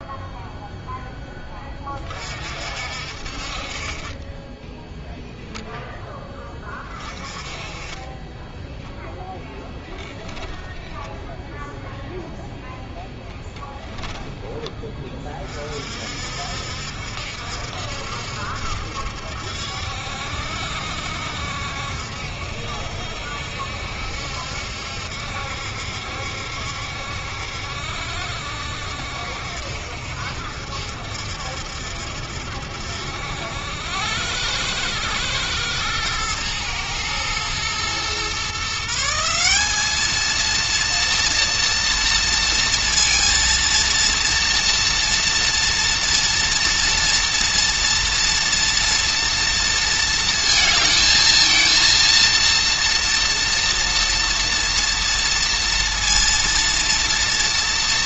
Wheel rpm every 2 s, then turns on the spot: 0, 50, 0, 20, 0, 0, 0, 20, 70, 70, 70, 70, 70, 70, 70, 70, 70, 100, 110, 150, 230, 230, 230, 240, 230, 220, 230, 230, 230.
none